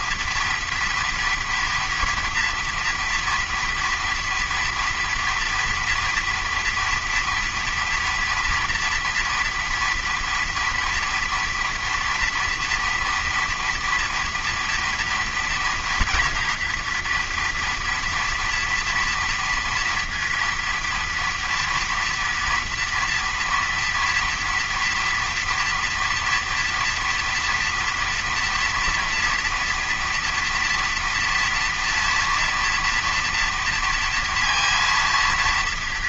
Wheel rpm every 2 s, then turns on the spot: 230, 230, 230, 230, 230, 230, 230, 230, 240, 230, 230, 230, 230, 230, 230, 230, 230, 230.
none